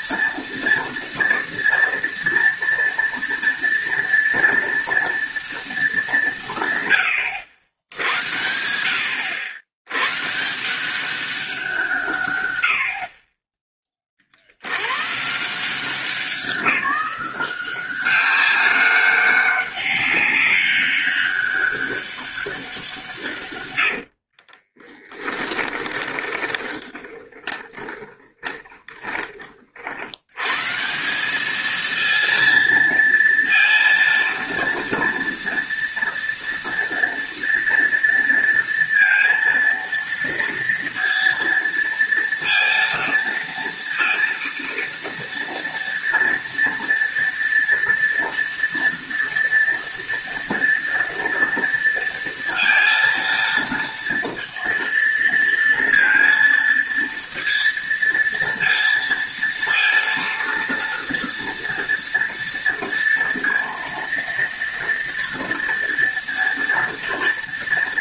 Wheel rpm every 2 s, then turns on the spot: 230, 230, 240, 110, 90, 180, 60, 110, 180, 200, 200, 170, 30, 20, 20, 170, 230, 230, 230, 230, 230, 230, 230, 230, 230, 230, 230, 230, 230, 230, 230, 230, 230, 230.
24-30